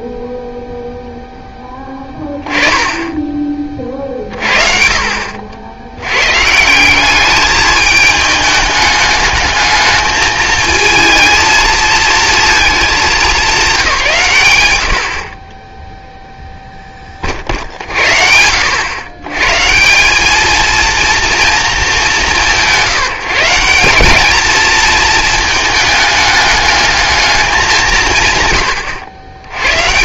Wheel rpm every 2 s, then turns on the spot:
0, 10, 50, 170, 210, 220, 210, 90, 10, 90, 230, 140, 230, 210, 100.
none